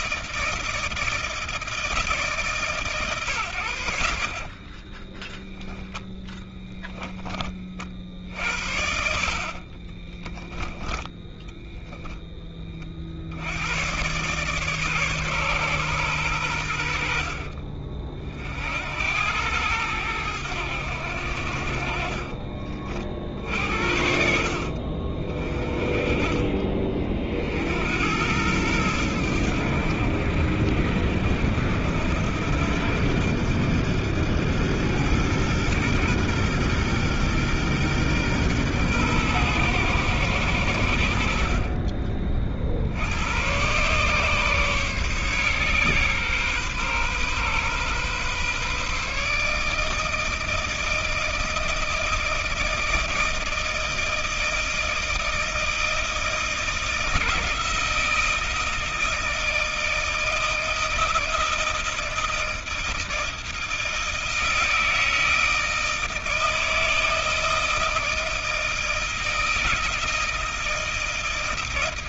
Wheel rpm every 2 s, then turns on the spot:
160, 150, 40, 10, 70, 20, 20, 140, 90, 60, 90, 50, 50, 30, 100, 70, 80, 100, 120, 120, 90, 50, 140, 130, 140, 160, 160, 160, 160, 160, 160, 160, 160, 160, 160, 160.
none